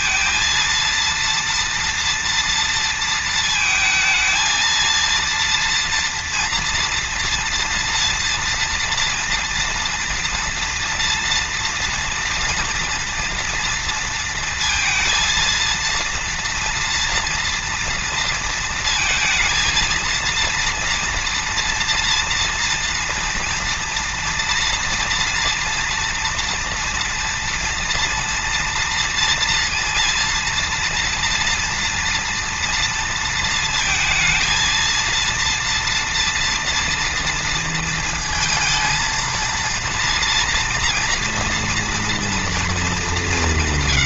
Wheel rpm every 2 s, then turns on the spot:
230, 230, 230, 230, 230, 230, 230, 230, 230, 230, 230, 230, 230, 230, 230, 230, 230, 230, 230, 230, 240, 200.
none